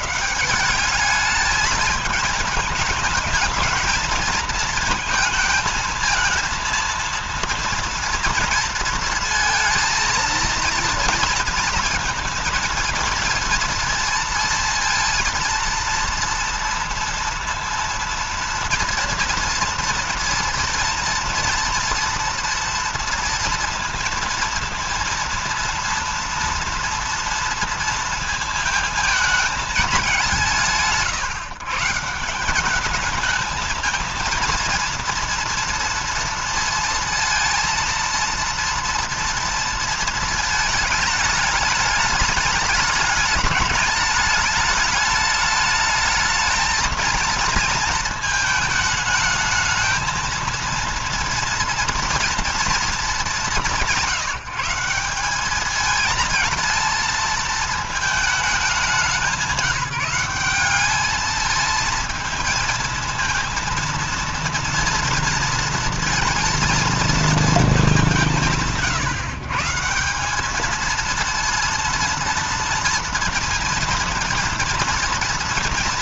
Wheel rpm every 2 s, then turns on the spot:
160, 210, 220, 230, 230, 230, 230, 230, 230, 230, 230, 230, 230, 230, 220, 170, 190, 230, 230, 230, 220, 210, 210, 220, 220, 230, 230, 170, 220, 210, 200, 220, 230, 230, 170, 210, 230, 230.
none